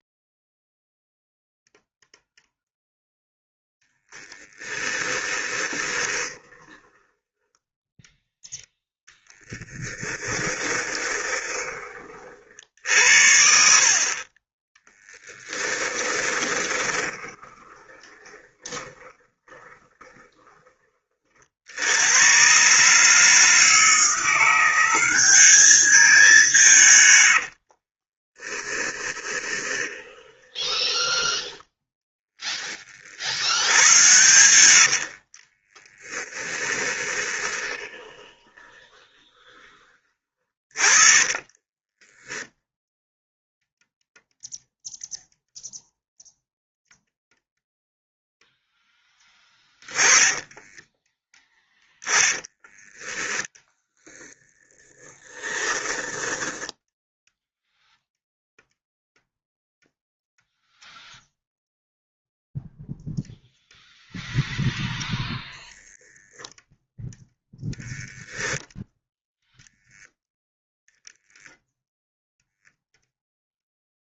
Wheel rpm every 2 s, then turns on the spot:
0, 0, 20, 10, 0, 10, 70, 20, 20, 20, 30, 150, 190, 130, 20, 10, 50, 70, 20, 20, 30, 0, 0, 0, 10, 10, 10, 30, 10, 0, 0, 0, 0, 0, 0, 0, 0.
4-8 10-12 14-20 26-32 34-42 48-52 54-58